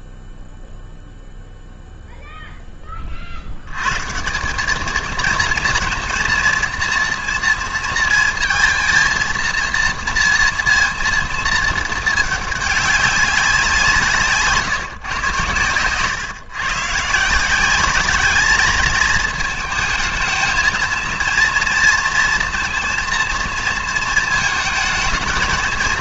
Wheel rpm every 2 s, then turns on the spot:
0, 10, 200, 230, 230, 230, 210, 150, 140, 210, 230, 230, 220.
none